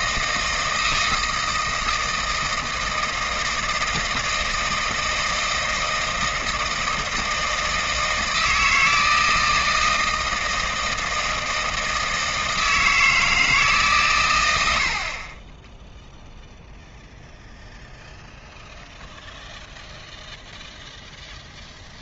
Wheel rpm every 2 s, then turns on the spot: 160, 160, 160, 160, 160, 160, 160, 70, 0, 0, 0.
none